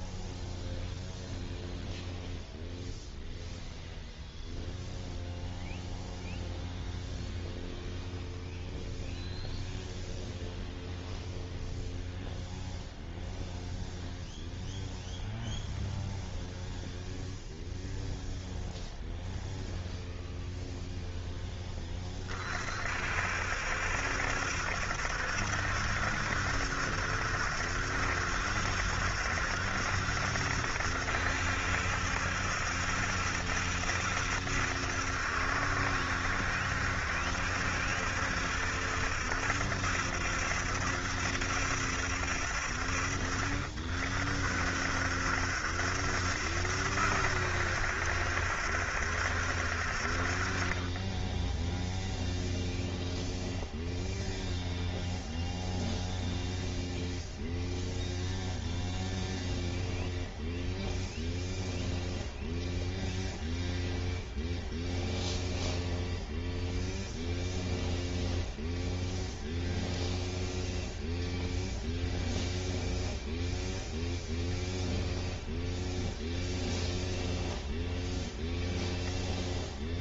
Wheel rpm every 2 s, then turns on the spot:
0, 0, 0, 0, 0, 0, 0, 0, 0, 0, 0, 50, 70, 70, 70, 70, 70, 70, 70, 70, 70, 50, 60, 70, 70, 30, 0, 0, 0, 0, 0, 0, 0, 0, 0, 0, 0, 0, 0, 0.
none